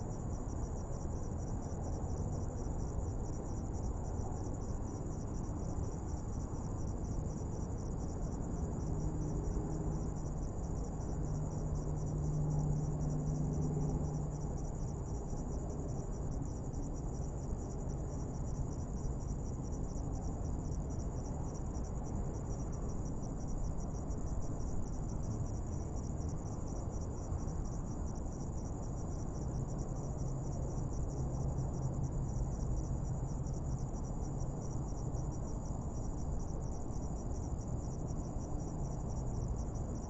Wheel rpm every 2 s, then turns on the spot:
0, 0, 0, 0, 0, 0, 0, 0, 0, 0, 0, 0, 0, 0, 0, 0, 0, 0, 0, 0.
none